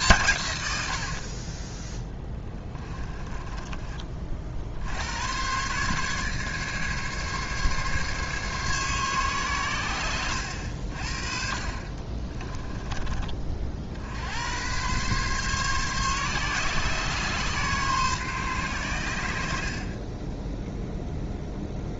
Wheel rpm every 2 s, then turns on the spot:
100, 20, 60, 140, 140, 80, 20, 110, 130, 120, 10.
2-4 12-14